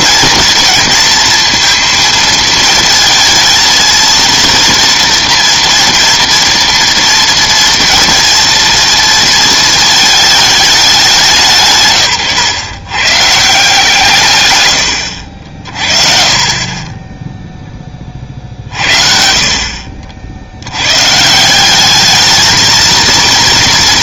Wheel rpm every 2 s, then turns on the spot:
230, 230, 230, 230, 230, 210, 120, 110, 30, 60, 100, 220.
none